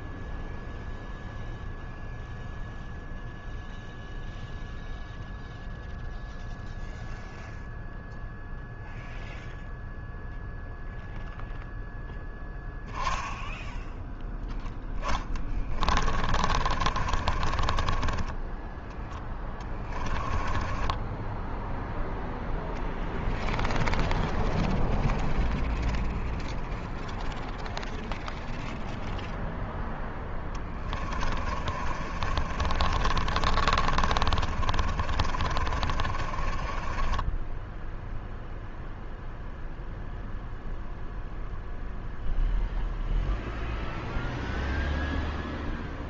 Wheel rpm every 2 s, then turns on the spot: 0, 0, 0, 0, 0, 0, 10, 20, 30, 10, 10, 0, 0, 0, 0, 20, 40, 40, 20, 0, 0, 0, 0.
14-22 30-38